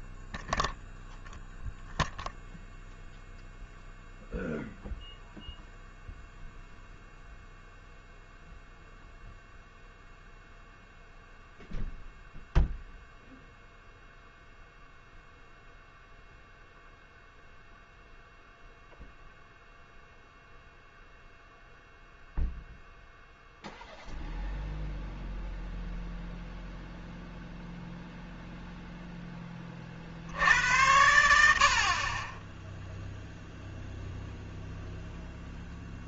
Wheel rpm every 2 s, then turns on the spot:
0, 0, 0, 0, 0, 0, 0, 0, 0, 0, 0, 0, 0, 0, 0, 80, 0, 0.
none